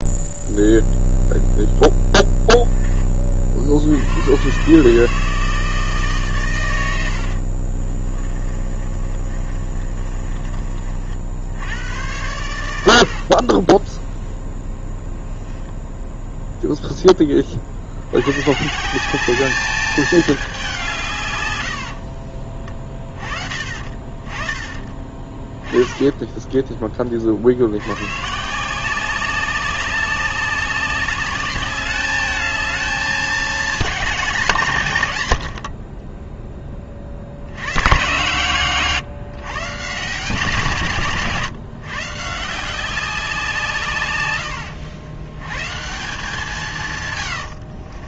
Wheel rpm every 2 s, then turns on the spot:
0, 10, 140, 110, 40, 40, 90, 10, 0, 150, 190, 30, 20, 20, 170, 200, 210, 150, 30, 130, 170, 170, 100, 140.
8-10